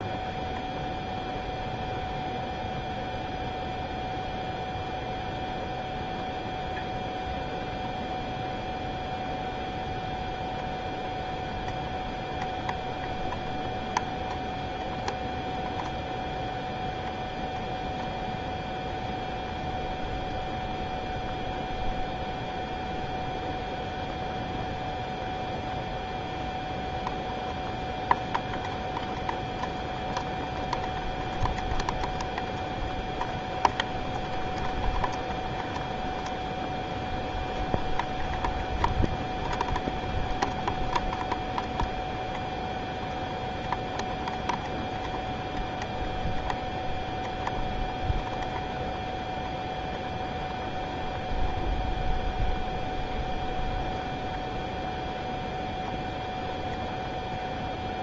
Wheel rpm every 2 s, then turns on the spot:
0, 0, 0, 0, 0, 0, 0, 0, 0, 0, 0, 0, 0, 0, 0, 0, 0, 0, 0, 0, 0, 0, 0, 0, 0, 0, 0, 0, 0.
none